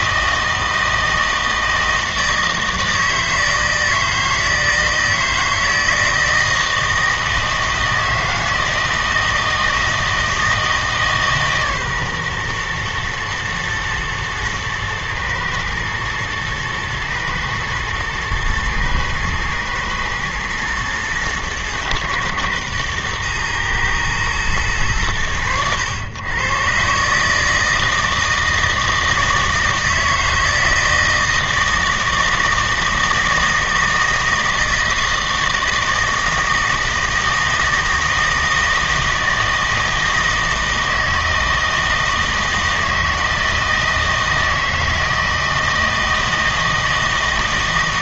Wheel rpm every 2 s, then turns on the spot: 160, 160, 160, 160, 160, 160, 120, 110, 110, 110, 110, 110, 110, 130, 160, 160, 160, 160, 160, 160, 160, 160, 160, 160.
none